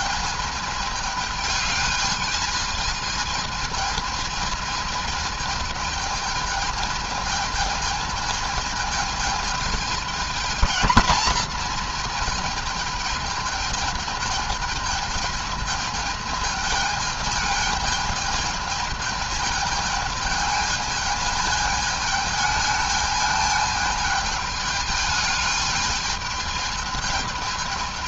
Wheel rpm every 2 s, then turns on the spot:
220, 220, 220, 220, 220, 220, 220, 220, 220, 220, 220, 220, 210, 220.
none